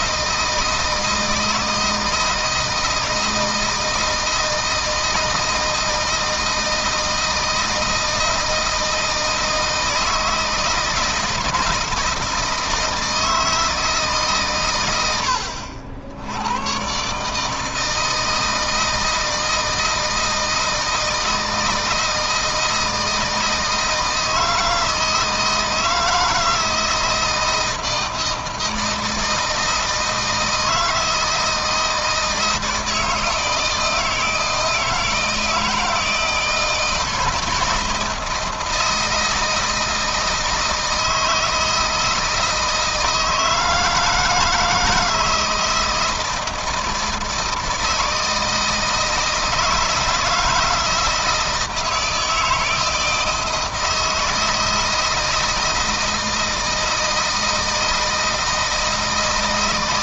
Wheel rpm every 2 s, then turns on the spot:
160, 160, 160, 160, 160, 160, 160, 110, 120, 160, 160, 160, 160, 160, 160, 160, 160, 160, 160, 160, 160, 160, 160, 160, 160, 160, 160, 160, 160, 160.
none